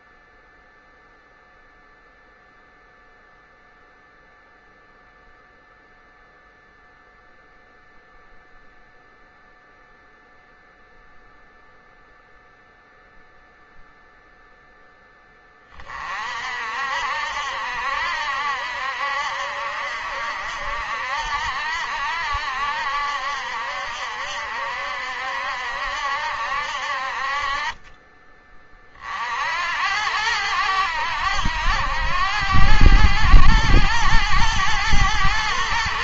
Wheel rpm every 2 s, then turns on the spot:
0, 0, 0, 0, 0, 0, 0, 10, 60, 70, 70, 70, 70, 60, 50, 90, 100, 100.
none